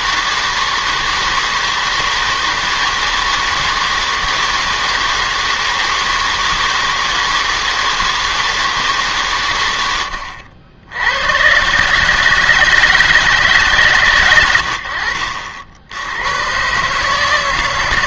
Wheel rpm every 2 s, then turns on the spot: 160, 160, 160, 160, 160, 80, 160, 100, 120.
none